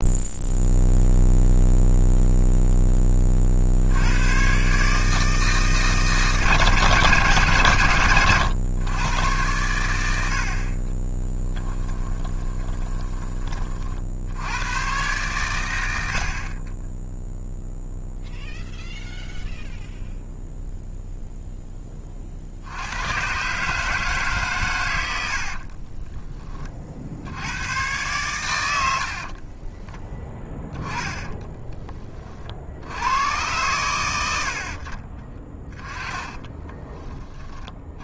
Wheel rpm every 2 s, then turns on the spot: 0, 0, 130, 140, 110, 40, 20, 100, 40, 0, 0, 80, 120, 30, 110, 10, 60, 60, 20.
12-14 36-38